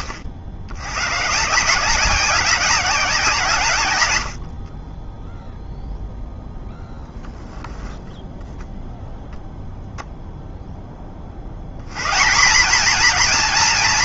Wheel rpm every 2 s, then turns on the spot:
110, 180, 10, 10, 0, 50, 230.
6-8